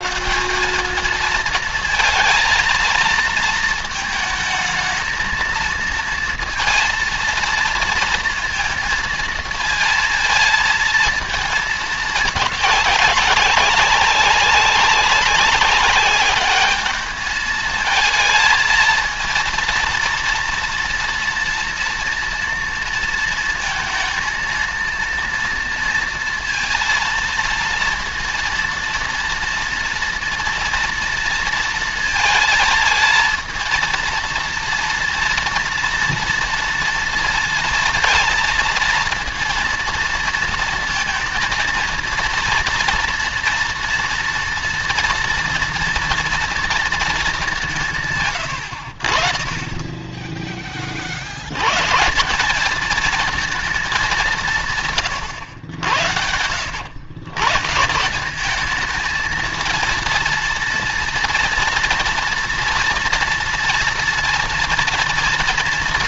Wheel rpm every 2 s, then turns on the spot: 200, 230, 220, 230, 220, 220, 200, 200, 210, 230, 230, 230, 230, 230, 230, 230, 230, 230, 230, 230, 230, 230, 230, 220, 60, 30, 220, 140, 90, 210, 230, 240, 230.
none